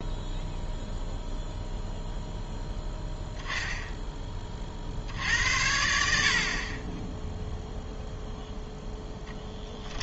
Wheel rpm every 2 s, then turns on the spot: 0, 0, 40, 40, 0.
none